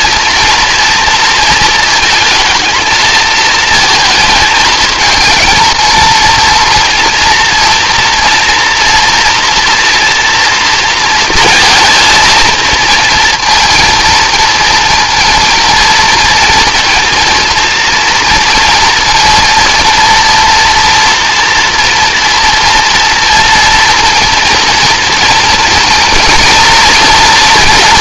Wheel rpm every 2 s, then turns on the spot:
230, 230, 220, 230, 230, 230, 220, 230, 230, 230, 240, 230, 230, 230.
none